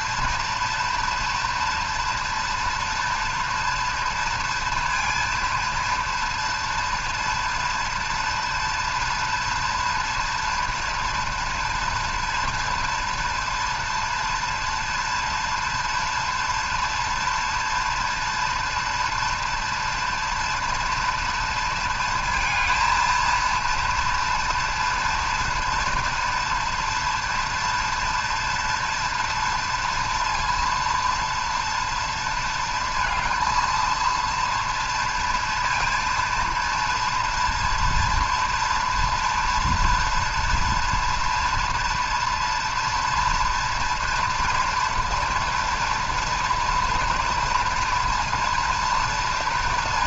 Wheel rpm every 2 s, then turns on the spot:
230, 230, 230, 240, 230, 230, 240, 230, 240, 230, 230, 230, 230, 230, 230, 230, 230, 230, 230, 230, 230, 230, 230, 230, 230.
none